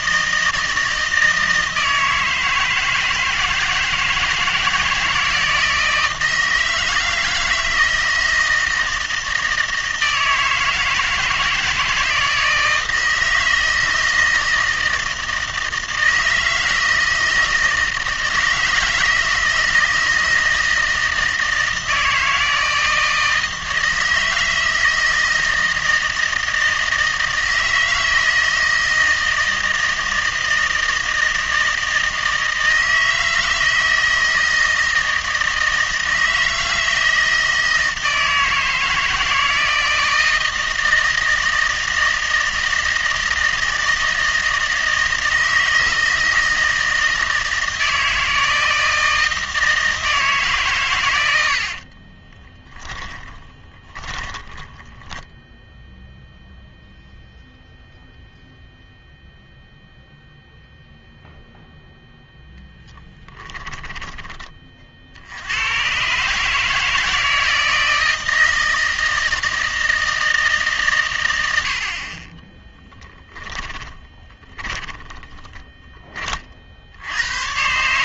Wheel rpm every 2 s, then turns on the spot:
160, 160, 160, 160, 160, 160, 160, 160, 160, 160, 160, 160, 160, 160, 160, 160, 160, 160, 160, 160, 160, 160, 160, 160, 160, 130, 10, 10, 0, 0, 0, 0, 30, 150, 160, 140, 10, 10, 50.
52-54 72-76